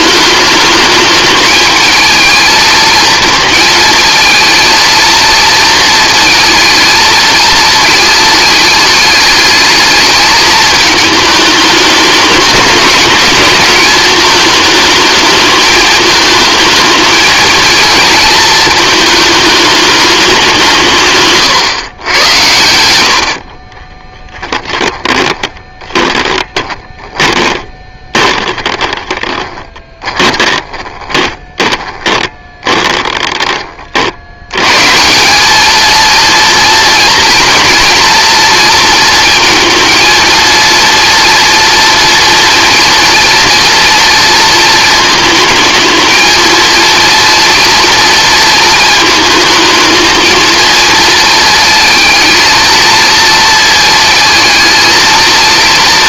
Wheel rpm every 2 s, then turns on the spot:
210, 220, 230, 220, 220, 220, 210, 220, 220, 220, 170, 90, 20, 20, 20, 20, 20, 130, 230, 230, 230, 230, 230, 230, 220, 230, 230, 230.
24-34